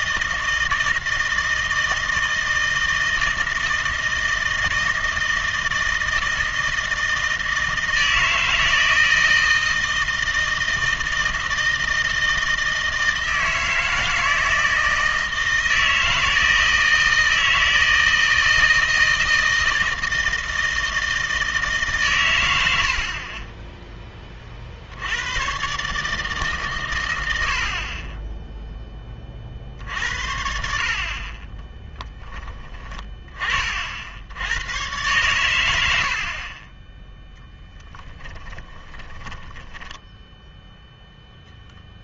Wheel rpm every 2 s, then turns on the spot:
160, 160, 160, 160, 160, 160, 160, 160, 160, 160, 160, 80, 70, 130, 10, 60, 20, 110, 20, 10, 0.
36-40